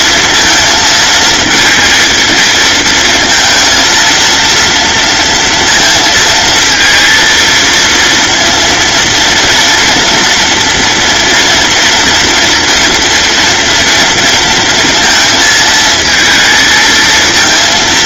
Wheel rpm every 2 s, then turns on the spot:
230, 230, 230, 230, 230, 230, 230, 230, 220.
none